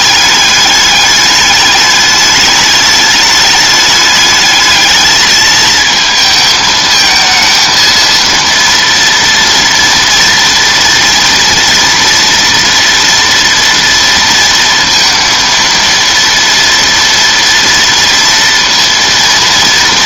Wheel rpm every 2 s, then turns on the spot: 210, 210, 210, 220, 230, 230, 230, 230, 230, 230.
none